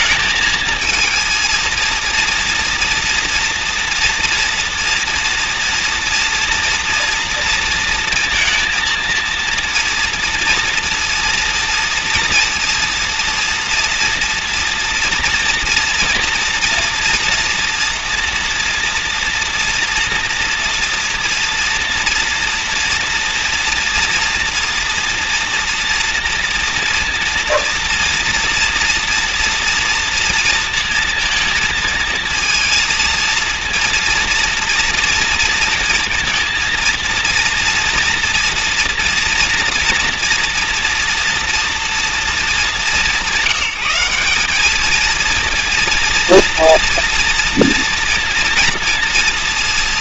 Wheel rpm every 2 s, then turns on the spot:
220, 230, 230, 230, 230, 230, 230, 230, 230, 240, 240, 230, 230, 230, 230, 230, 230, 230, 230, 240, 240, 200, 210, 230, 230.
none